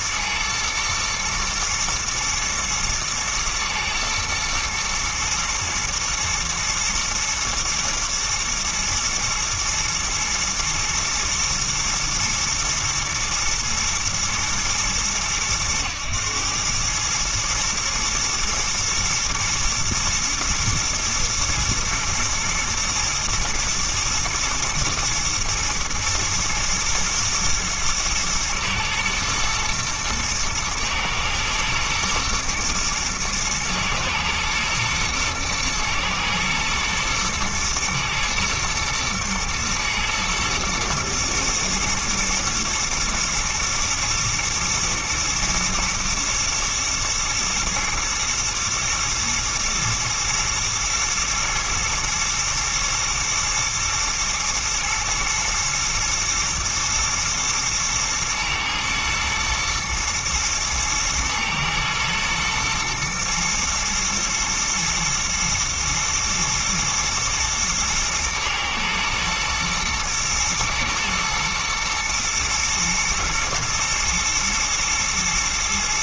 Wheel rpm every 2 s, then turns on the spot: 120, 120, 110, 110, 110, 110, 120, 110, 110, 120, 120, 120, 110, 110, 110, 110, 110, 110, 110, 120, 110, 110, 110, 110, 110, 120, 120, 110, 120, 110, 120, 120, 110, 110, 110, 120, 120, 120.
none